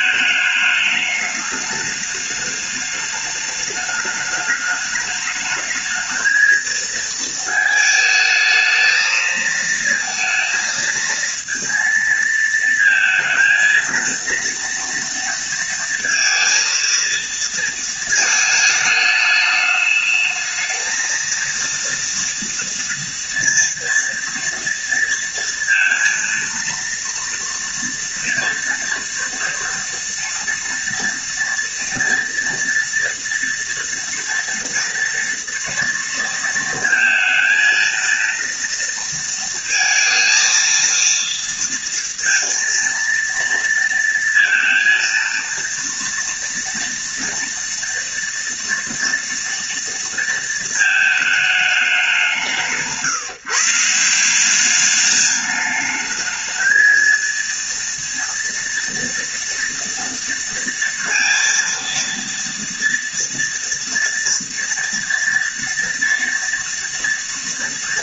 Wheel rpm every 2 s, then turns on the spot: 210, 210, 210, 230, 220, 230, 230, 230, 230, 220, 220, 230, 230, 230, 230, 240, 230, 230, 230, 230, 230, 230, 230, 230, 230, 220, 160, 200, 220, 230, 230, 230, 230, 230.
none